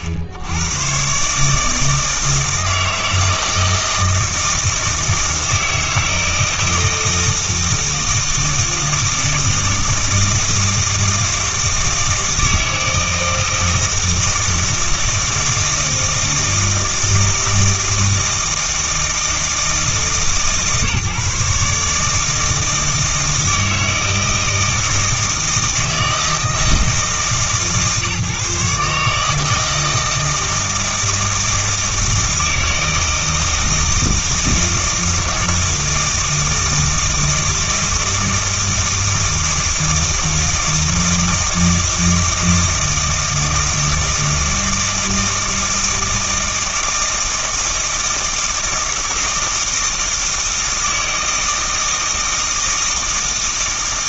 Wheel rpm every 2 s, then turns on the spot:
90, 160, 160, 160, 160, 160, 160, 160, 160, 160, 150, 160, 160, 160, 140, 160, 160, 160, 160, 160, 160, 160, 160, 160, 160, 160, 160.
none